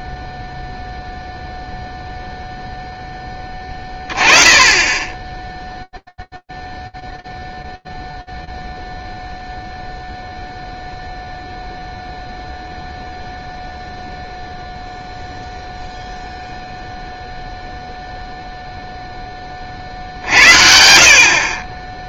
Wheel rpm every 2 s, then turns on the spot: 0, 10, 20, 0, 0, 0, 0, 0, 0, 10, 60.
none